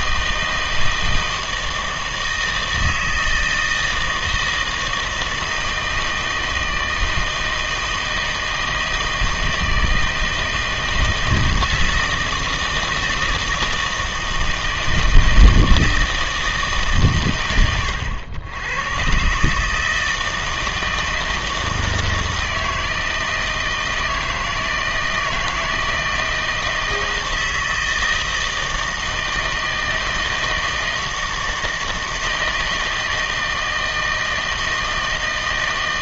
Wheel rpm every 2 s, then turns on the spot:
160, 160, 160, 160, 160, 160, 160, 160, 150, 100, 160, 160, 160, 160, 160, 160, 160, 160.
none